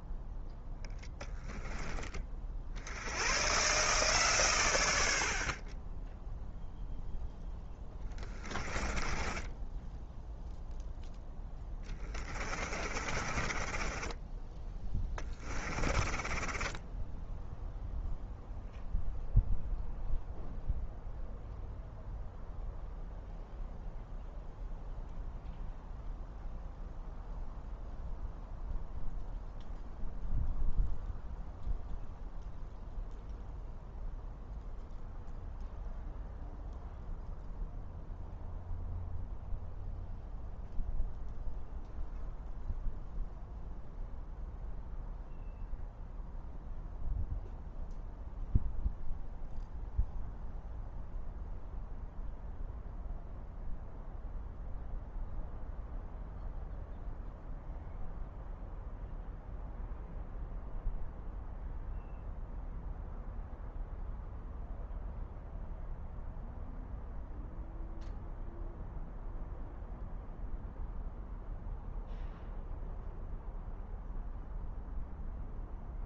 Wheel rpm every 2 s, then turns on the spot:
0, 70, 90, 0, 20, 0, 40, 20, 10, 0, 0, 0, 0, 0, 0, 0, 0, 0, 0, 0, 0, 0, 0, 0, 0, 0, 0, 0, 0, 0, 0, 0, 0, 0, 0, 0, 0, 0.
8-10 12-18